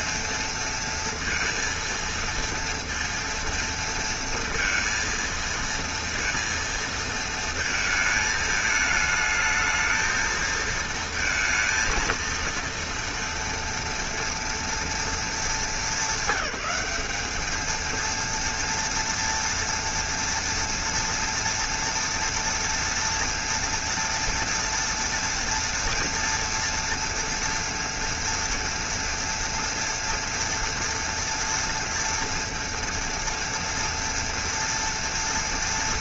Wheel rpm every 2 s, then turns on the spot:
230, 230, 230, 230, 220, 230, 230, 230, 200, 230, 230, 230, 230, 230, 230, 240, 230, 240.
none